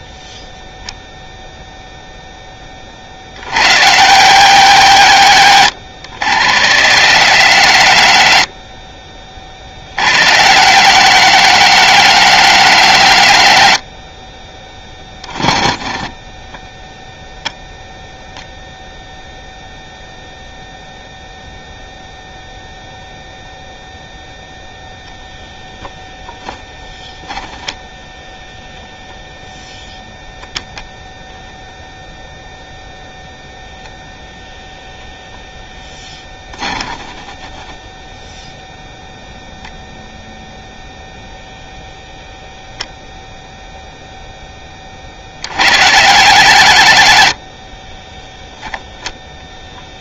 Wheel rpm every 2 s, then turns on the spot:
0, 10, 90, 60, 30, 80, 90, 20, 10, 0, 0, 0, 0, 0, 10, 0, 0, 0, 10, 0, 0, 0, 10, 80, 0.
none